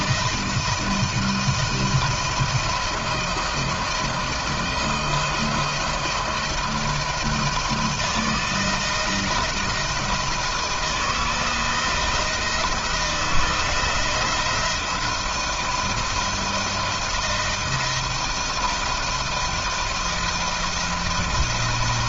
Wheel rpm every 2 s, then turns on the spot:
170, 160, 160, 160, 160, 170, 170, 170, 170, 160, 170.
none